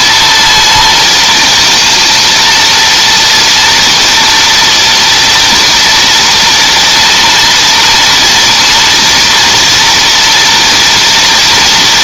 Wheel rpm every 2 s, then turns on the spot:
230, 230, 230, 230, 240, 230.
none